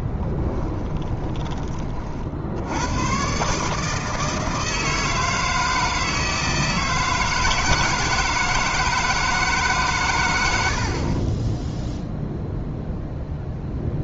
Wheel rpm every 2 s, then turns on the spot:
20, 90, 160, 160, 160, 70, 0.
0-2